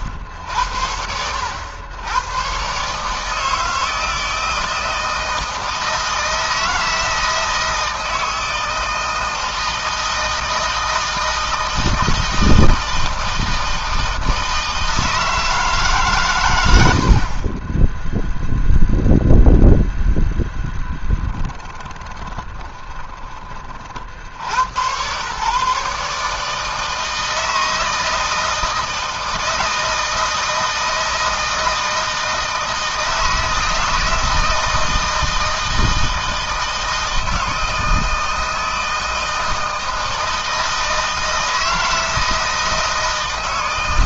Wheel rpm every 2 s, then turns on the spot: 70, 140, 160, 160, 160, 160, 160, 160, 70, 0, 10, 20, 120, 160, 160, 160, 160, 160, 160, 160, 160, 160.
20-24